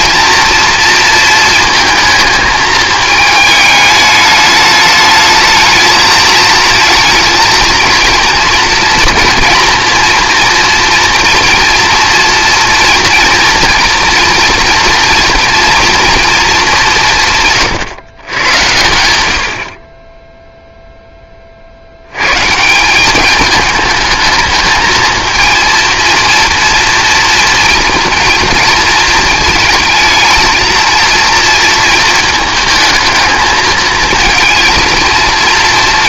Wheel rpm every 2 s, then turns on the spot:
230, 220, 210, 230, 230, 240, 230, 230, 190, 90, 0, 180, 220, 230, 230, 230, 220, 220.
none